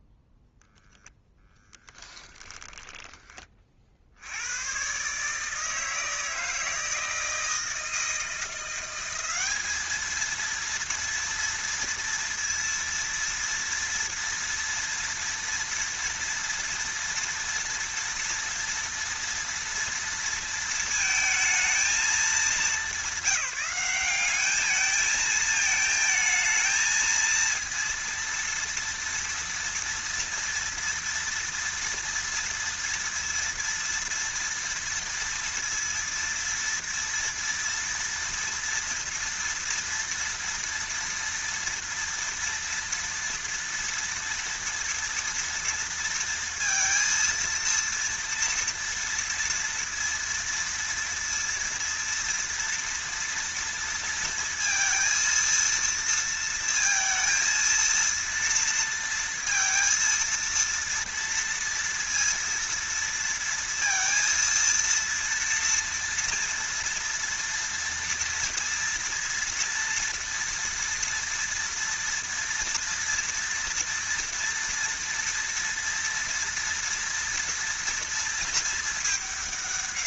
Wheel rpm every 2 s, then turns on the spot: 0, 10, 120, 160, 180, 230, 230, 230, 230, 230, 230, 190, 220, 220, 230, 230, 230, 230, 230, 230, 230, 230, 230, 230, 230, 230, 230, 230, 230, 230, 230, 230, 230, 230, 230, 230, 230, 230, 230, 220.
2-4